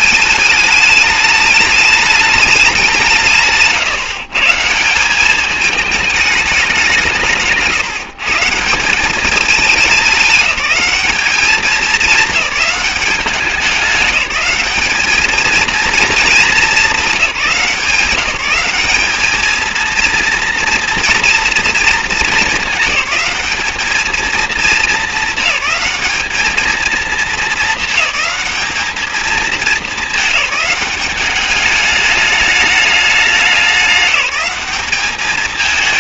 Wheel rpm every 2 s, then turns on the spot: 220, 190, 150, 200, 170, 200, 210, 200, 220, 190, 230, 210, 220, 220, 210, 210, 210, 200.
none